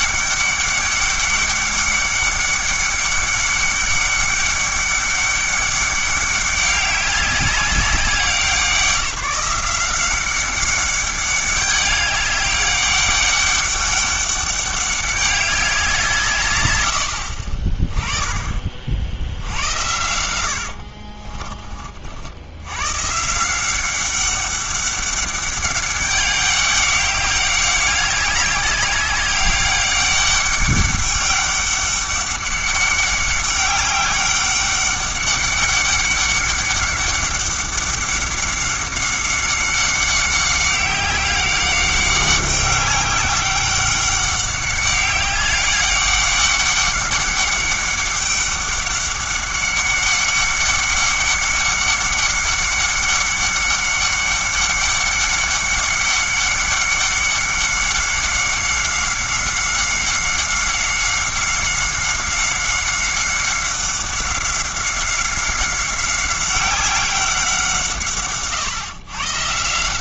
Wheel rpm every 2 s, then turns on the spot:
200, 200, 200, 200, 180, 200, 200, 200, 100, 40, 70, 110, 200, 200, 200, 200, 200, 200, 200, 200, 190, 190, 200, 200, 200, 200, 200, 200, 190, 190, 190, 190, 190, 190, 140.
16-18 20-22